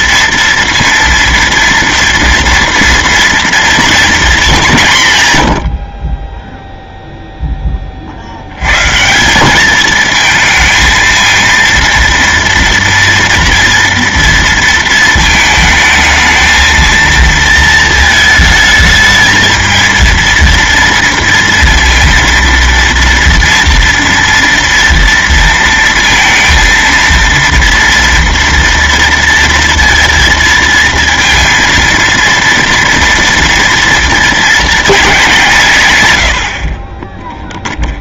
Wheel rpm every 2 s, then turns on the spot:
230, 230, 190, 0, 110, 220, 230, 230, 220, 220, 230, 230, 230, 230, 230, 230, 230, 220, 60.
none